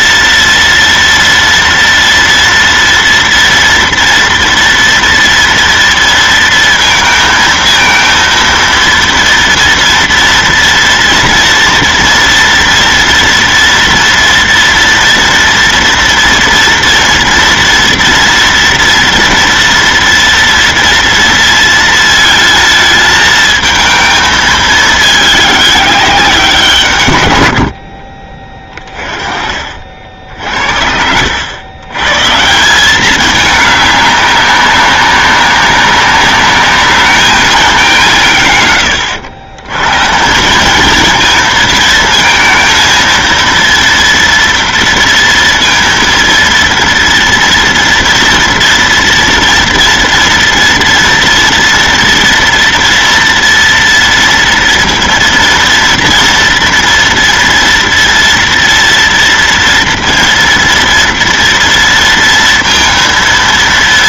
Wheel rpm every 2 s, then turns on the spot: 230, 230, 230, 230, 230, 230, 230, 230, 230, 230, 230, 220, 210, 130, 30, 70, 200, 190, 210, 100, 220, 230, 230, 230, 230, 230, 230, 230, 230, 230, 230, 230.
none